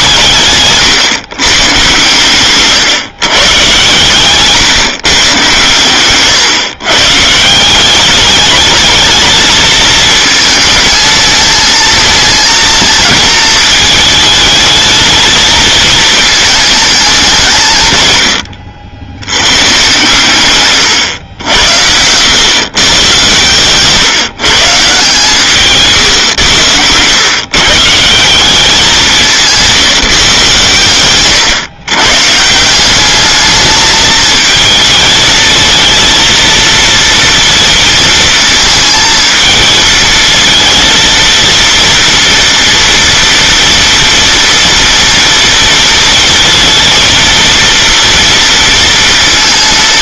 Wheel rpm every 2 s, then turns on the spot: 140, 130, 140, 130, 210, 220, 220, 220, 210, 80, 130, 120, 140, 100, 190, 130, 180, 220, 230, 230, 230, 230, 230, 230, 230.
0-2